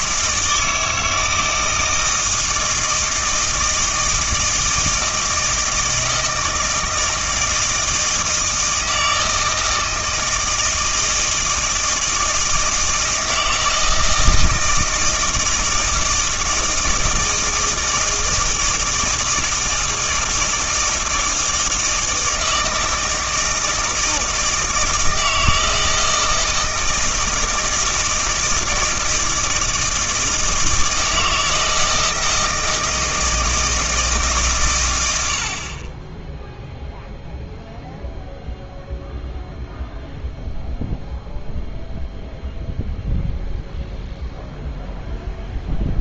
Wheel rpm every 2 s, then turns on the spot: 160, 160, 160, 160, 160, 160, 160, 160, 160, 160, 160, 160, 160, 160, 160, 160, 160, 120, 0, 0, 0, 0, 0.
none